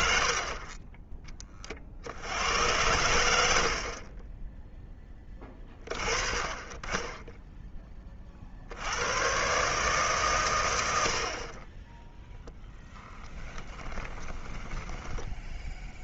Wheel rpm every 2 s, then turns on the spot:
50, 90, 10, 30, 60, 110, 0, 10.
14-16